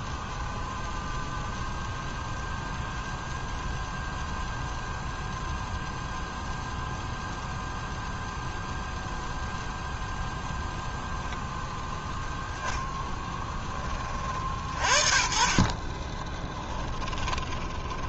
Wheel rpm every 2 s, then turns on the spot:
0, 0, 0, 0, 0, 0, 10, 40, 20.
16-18